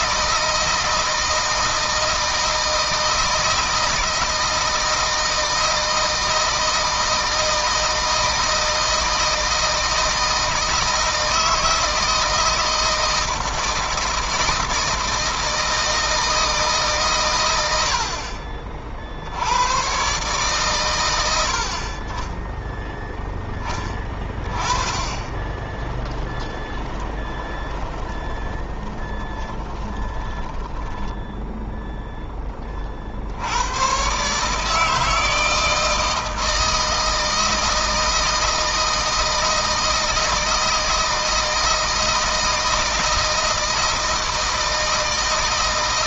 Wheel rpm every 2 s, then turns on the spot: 160, 160, 160, 160, 160, 160, 160, 160, 140, 50, 120, 10, 20, 20, 20, 10, 30, 160, 160, 160, 160, 160, 160.
26-32